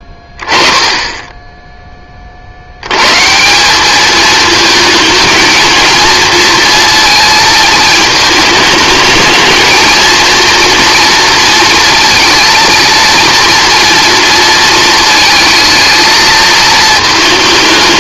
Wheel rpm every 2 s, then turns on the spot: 10, 60, 220, 230, 210, 230, 230, 230, 230.
none